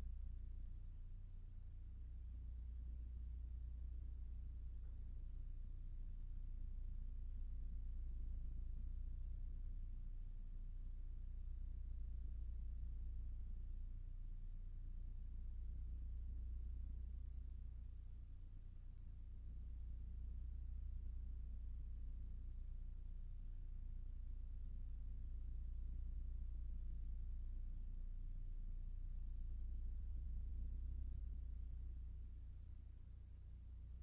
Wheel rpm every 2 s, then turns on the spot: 0, 0, 0, 0, 0, 0, 0, 0, 0, 0, 0, 0, 0, 0, 0, 0, 0.
none